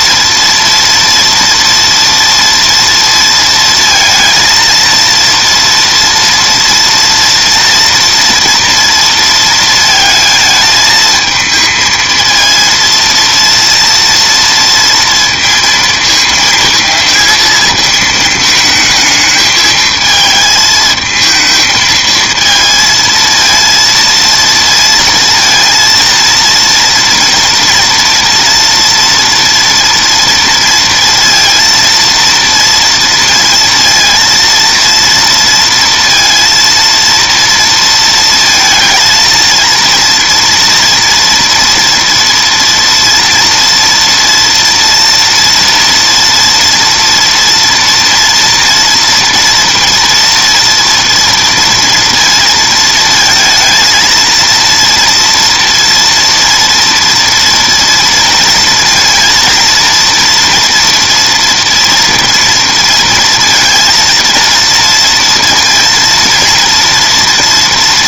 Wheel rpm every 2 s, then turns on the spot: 230, 230, 230, 230, 230, 220, 230, 230, 230, 220, 220, 220, 230, 230, 240, 230, 230, 230, 230, 230, 240, 230, 230, 230, 240, 230, 230, 230, 230, 230, 230, 230, 230, 230.
none